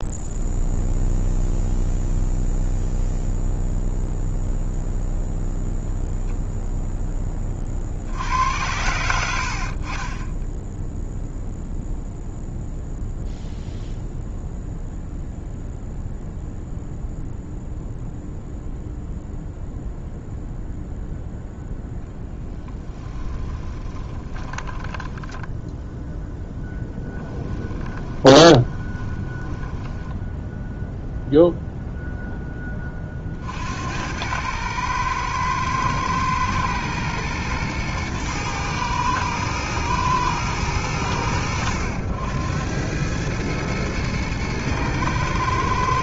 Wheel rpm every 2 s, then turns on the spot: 0, 0, 0, 10, 90, 0, 0, 0, 0, 0, 0, 20, 10, 10, 20, 0, 30, 110, 120, 110, 100, 100, 110.
8-10 22-30